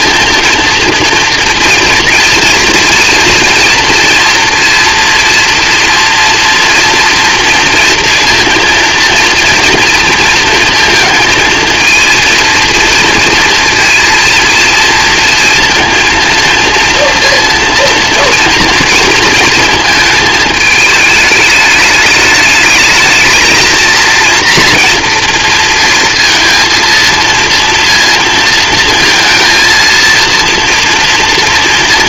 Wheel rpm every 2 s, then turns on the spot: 230, 230, 240, 230, 230, 230, 230, 230, 230, 230, 220, 220, 230, 230, 230, 230.
none